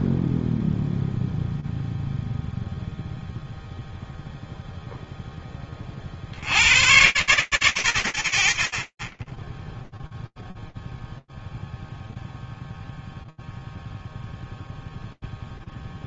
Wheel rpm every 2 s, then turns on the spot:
0, 0, 0, 30, 20, 0, 0, 0.
none